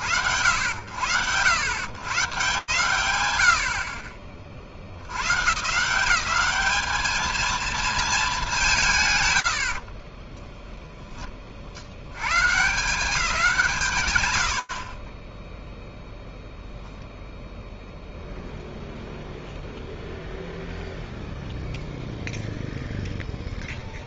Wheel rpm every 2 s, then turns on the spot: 120, 50, 190, 220, 20, 120, 100, 0, 0, 0, 0, 60.
8-10